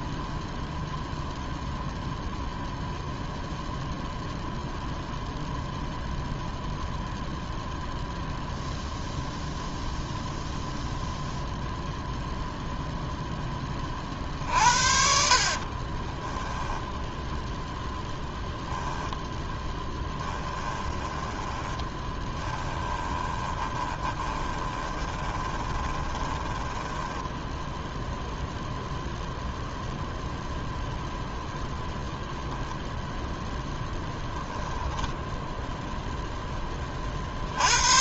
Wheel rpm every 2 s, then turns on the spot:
0, 0, 0, 0, 0, 0, 0, 60, 10, 0, 10, 10, 20, 10, 0, 0, 0, 10, 20.
16-18 20-28 34-36